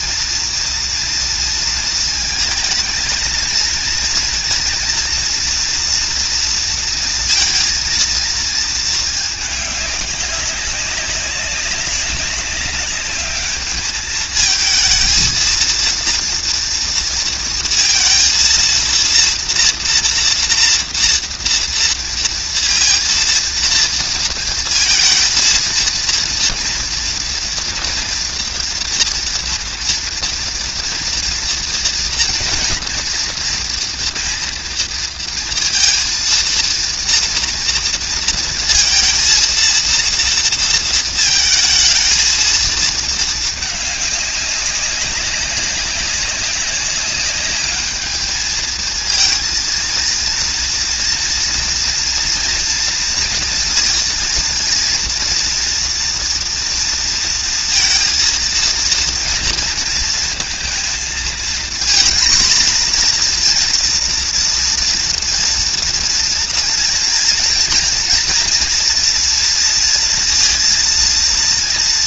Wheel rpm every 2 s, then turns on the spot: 230, 220, 230, 230, 230, 190, 200, 220, 230, 230, 230, 230, 230, 230, 230, 230, 240, 230, 230, 230, 230, 230, 200, 200, 220, 230, 240, 240, 240, 230, 230, 240, 240, 230, 230, 230.
none